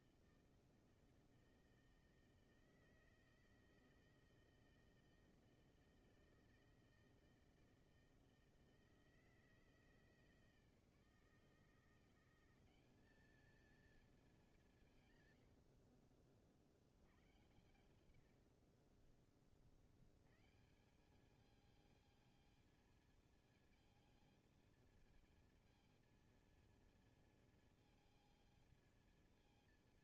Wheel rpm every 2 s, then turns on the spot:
160, 160, 160, 160, 160, 160, 200, 180, 60, 70, 140, 220, 230, 230, 220.
18-20